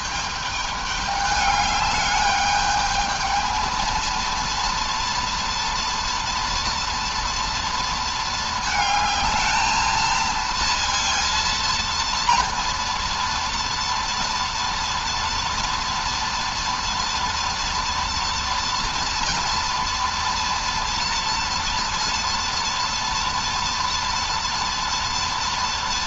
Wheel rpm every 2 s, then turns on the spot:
210, 210, 230, 230, 220, 230, 230, 230, 230, 230, 230, 230, 230.
none